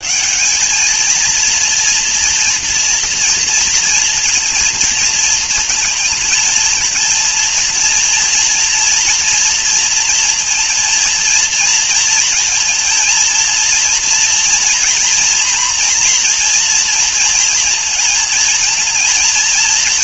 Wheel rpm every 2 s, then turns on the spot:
210, 230, 230, 220, 230, 230, 230, 230, 230, 230.
none